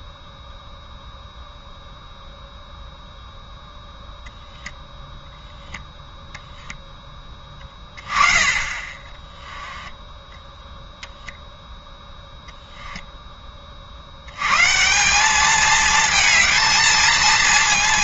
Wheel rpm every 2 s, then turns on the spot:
0, 0, 0, 10, 10, 0, 10, 190, 220.
6-10